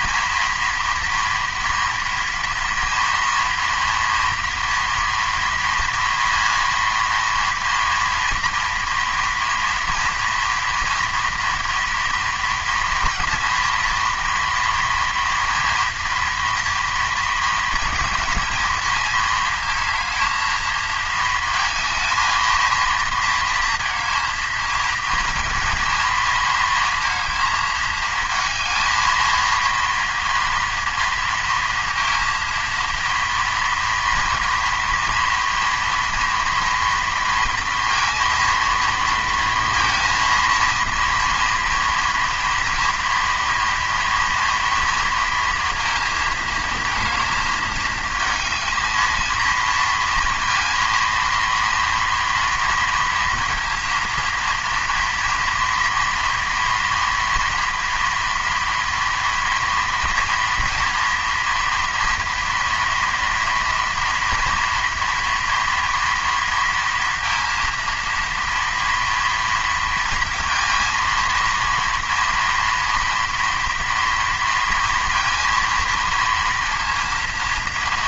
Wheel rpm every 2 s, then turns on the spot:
230, 230, 240, 230, 240, 230, 230, 230, 230, 220, 220, 230, 220, 230, 220, 230, 230, 230, 230, 230, 230, 230, 230, 230, 220, 230, 230, 230, 230, 230, 230, 230, 230, 230, 230, 230, 230, 230, 230.
none